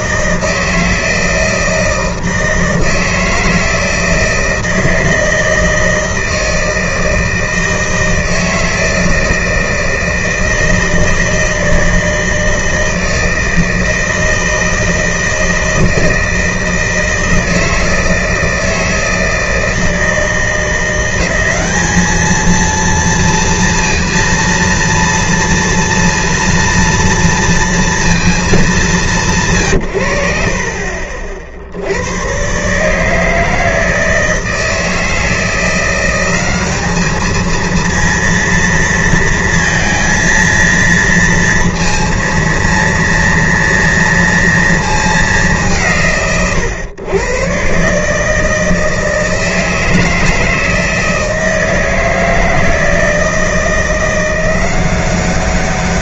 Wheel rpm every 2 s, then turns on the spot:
160, 160, 160, 160, 160, 160, 160, 160, 160, 160, 170, 230, 230, 230, 210, 60, 140, 160, 200, 230, 230, 230, 230, 120, 160, 160, 160, 180.
none